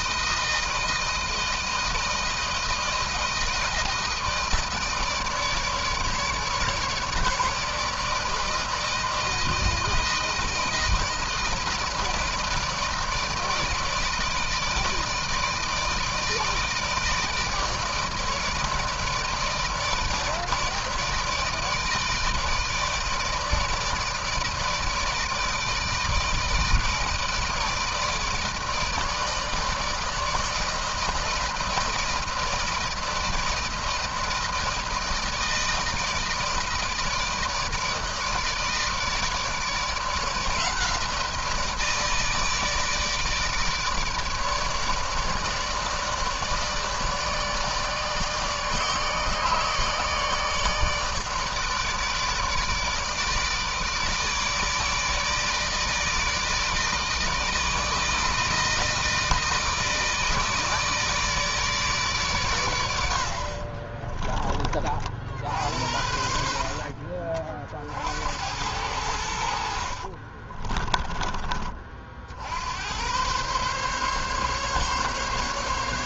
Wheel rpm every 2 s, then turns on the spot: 160, 160, 160, 150, 160, 160, 160, 160, 160, 160, 160, 160, 160, 160, 160, 160, 160, 160, 160, 150, 160, 160, 150, 160, 160, 150, 150, 150, 160, 160, 160, 90, 40, 50, 90, 20, 100, 140.
66-72